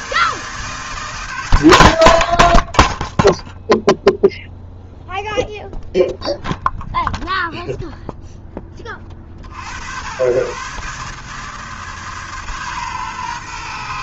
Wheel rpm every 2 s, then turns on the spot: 160, 30, 0, 0, 20, 140, 130.
none